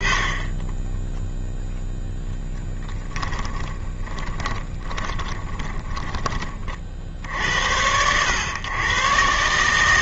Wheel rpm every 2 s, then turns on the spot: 20, 10, 30, 40, 120.
2-6